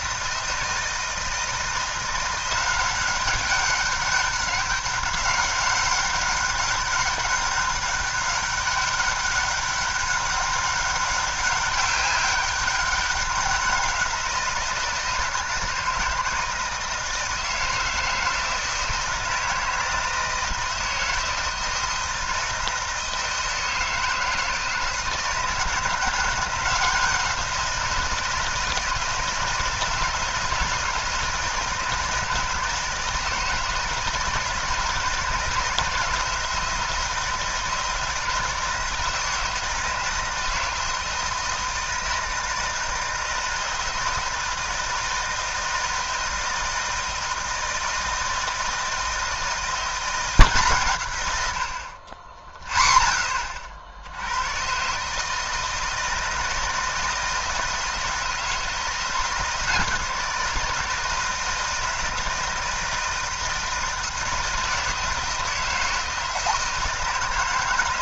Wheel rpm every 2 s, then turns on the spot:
160, 180, 200, 200, 200, 200, 200, 160, 160, 160, 160, 160, 160, 180, 160, 160, 160, 160, 160, 160, 160, 160, 160, 160, 160, 150, 0, 120, 160, 160, 160, 160, 160, 160.
none